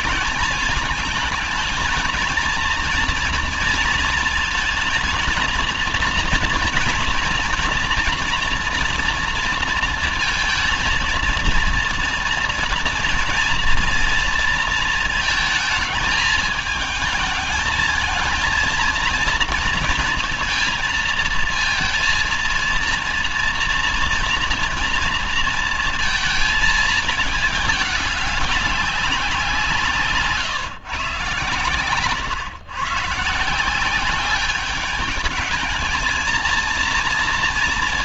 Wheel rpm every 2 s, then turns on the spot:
220, 230, 230, 230, 230, 230, 230, 230, 220, 230, 230, 230, 230, 230, 200, 140, 120, 200, 230.
none